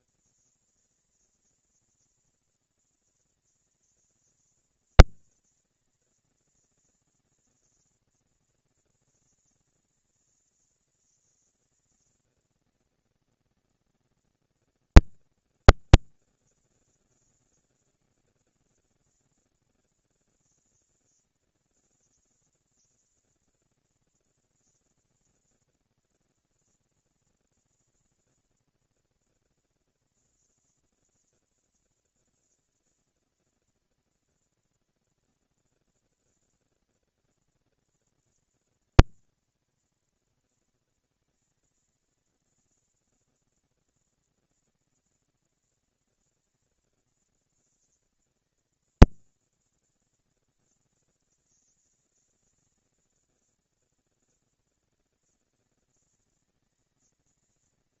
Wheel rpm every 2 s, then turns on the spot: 230, 230, 230, 230, 230, 230, 230, 230, 200, 210, 210, 230, 240, 230, 240, 230, 230, 230, 230, 230, 230, 230, 230, 220, 230, 200, 200, 220, 230.
none